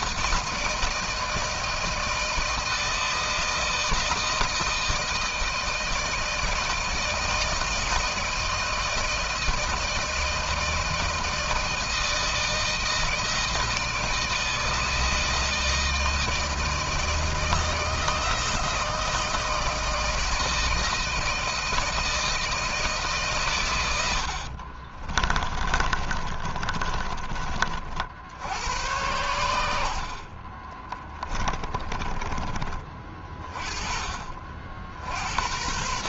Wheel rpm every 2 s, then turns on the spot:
160, 160, 160, 160, 160, 160, 160, 160, 160, 160, 160, 160, 60, 30, 90, 30, 30, 50.
24-28 30-32